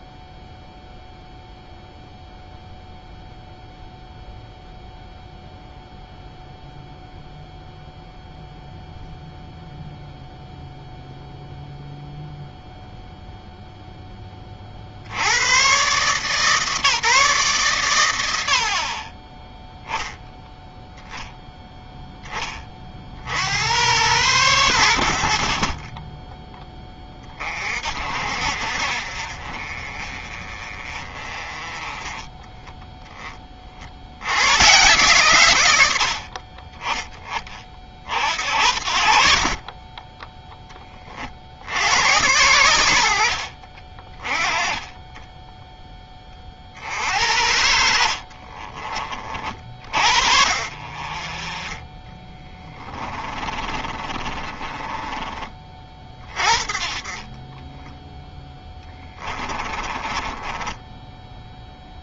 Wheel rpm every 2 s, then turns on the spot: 0, 0, 0, 0, 0, 0, 0, 80, 150, 60, 0, 50, 80, 20, 50, 30, 10, 130, 20, 60, 20, 90, 20, 60, 30, 40, 30, 30, 40, 10, 10.
48-50 52-56 58-62